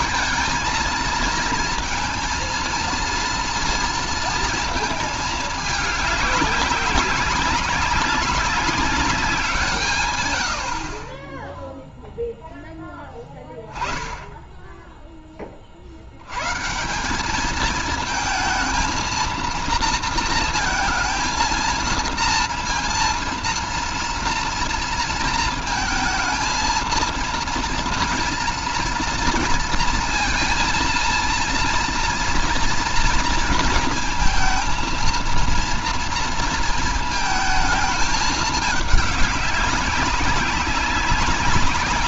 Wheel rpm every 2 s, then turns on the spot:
230, 230, 220, 200, 190, 50, 10, 10, 180, 230, 230, 230, 230, 230, 230, 230, 230, 230, 230, 200, 190.
none